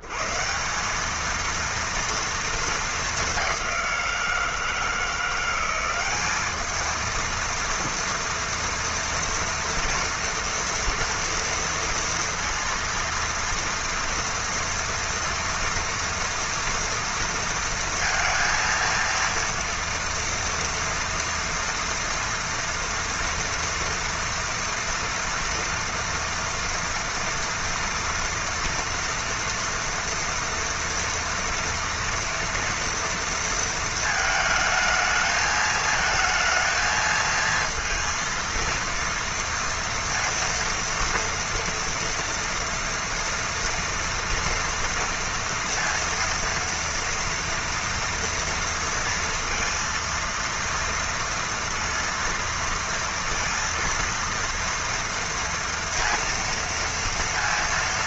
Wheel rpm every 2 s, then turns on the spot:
90, 230, 170, 200, 230, 230, 230, 230, 230, 230, 230, 240, 230, 230, 230, 230, 230, 220, 230, 230, 230, 230, 230, 230, 230, 230, 230, 230, 230.
none